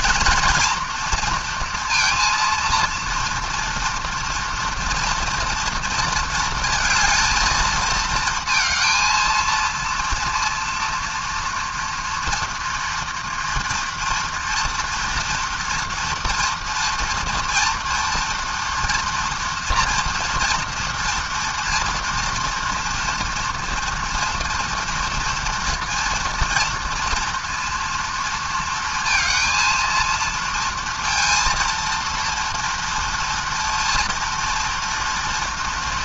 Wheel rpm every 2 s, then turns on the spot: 230, 230, 230, 220, 220, 230, 230, 230, 230, 230, 230, 230, 230, 230, 230, 230, 230, 230.
none